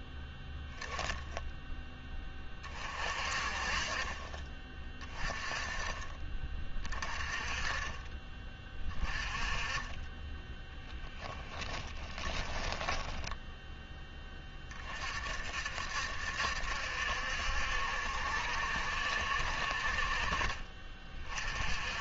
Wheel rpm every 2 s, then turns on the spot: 0, 30, 30, 30, 30, 20, 10, 30, 70, 70, 30.
10-14